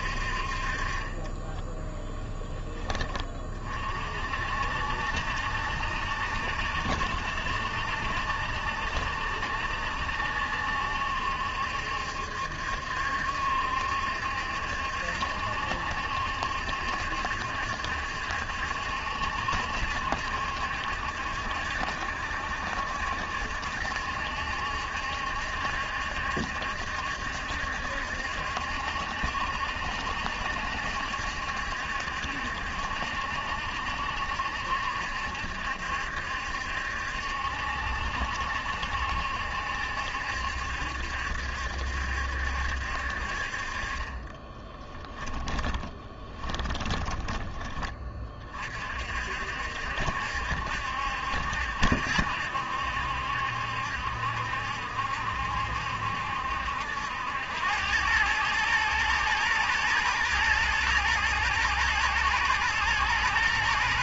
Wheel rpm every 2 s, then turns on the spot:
30, 20, 60, 70, 70, 70, 70, 70, 70, 70, 70, 70, 70, 70, 70, 70, 70, 70, 70, 70, 70, 60, 10, 20, 50, 70, 70, 70, 80, 110, 120, 120.
44-48